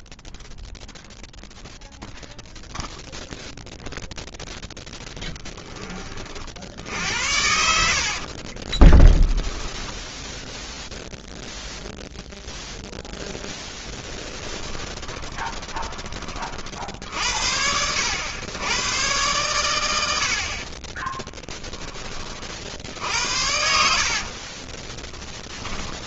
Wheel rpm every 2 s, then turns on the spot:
0, 0, 0, 60, 30, 0, 0, 20, 50, 100, 50, 50, 30.
8-10 14-16 24-26